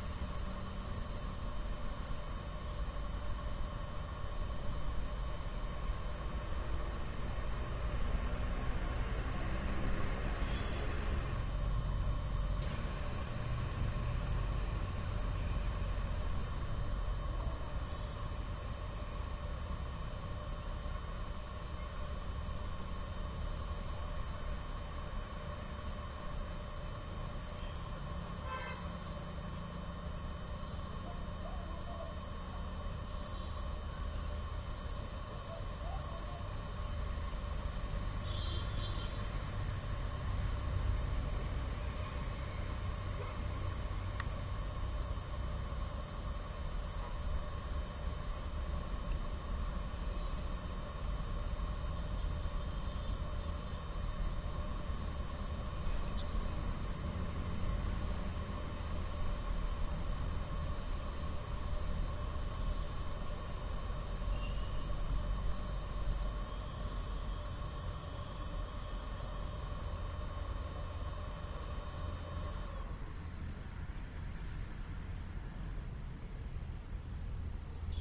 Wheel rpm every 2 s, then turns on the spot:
0, 0, 0, 0, 0, 0, 0, 0, 0, 0, 0, 0, 0, 0, 0, 0, 0, 0, 0, 0, 0, 0, 0, 0, 0, 0, 0, 0, 0, 0, 0, 0, 0, 0, 0, 0, 0, 0, 0.
none